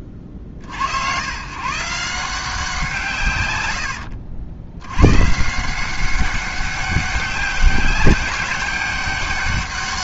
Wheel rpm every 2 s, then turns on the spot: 60, 180, 80, 200, 200.
none